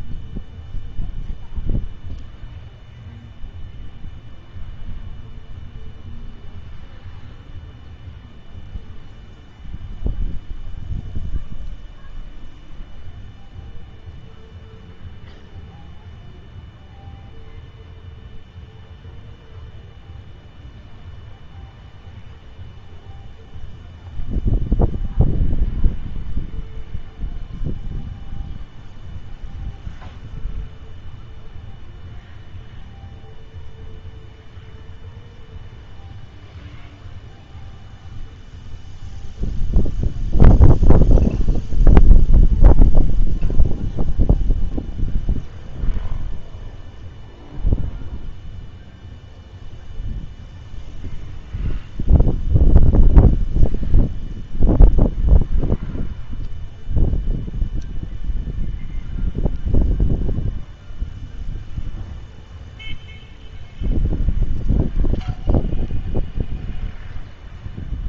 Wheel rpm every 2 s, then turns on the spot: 0, 0, 0, 0, 0, 0, 0, 0, 0, 0, 0, 0, 0, 0, 0, 0, 0, 0, 0, 0, 0, 0, 0, 0, 0, 0, 0, 0, 0, 0, 0, 0, 0, 0.
none